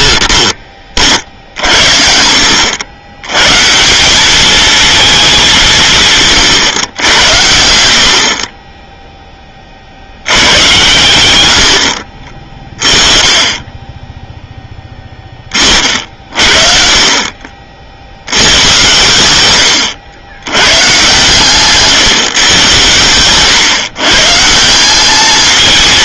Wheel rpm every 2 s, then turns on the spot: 20, 80, 220, 130, 20, 100, 20, 10, 50, 100, 110, 130, 170.
none